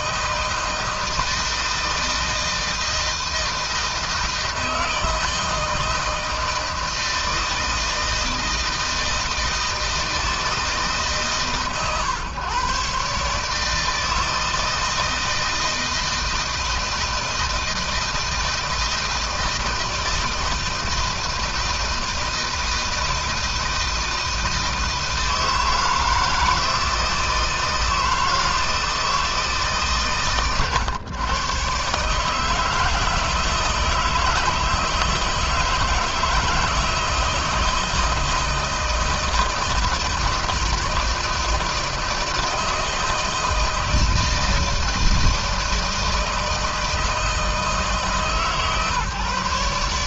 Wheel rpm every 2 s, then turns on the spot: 160, 160, 160, 160, 160, 150, 140, 160, 160, 160, 160, 160, 160, 160, 160, 110, 160, 160, 160, 160, 160, 160, 160, 160, 150.
none